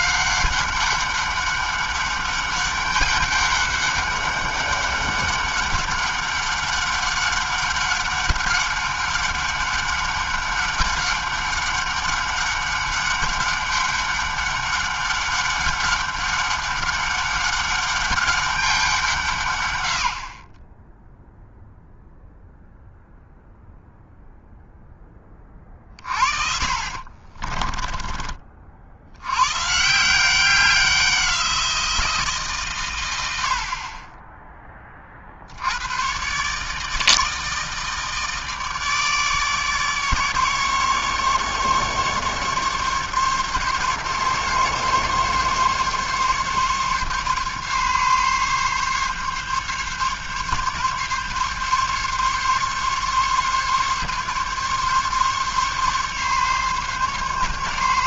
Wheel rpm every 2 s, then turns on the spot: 200, 200, 200, 200, 200, 200, 200, 200, 200, 180, 10, 0, 10, 30, 70, 180, 100, 50, 160, 150, 150, 140, 140, 140, 140, 140, 140, 140, 140.
26-28